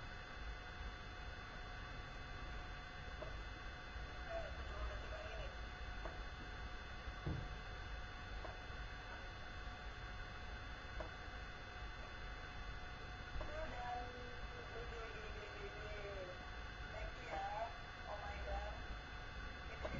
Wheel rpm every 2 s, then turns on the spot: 0, 0, 0, 0, 0, 0, 0, 0, 0, 0.
none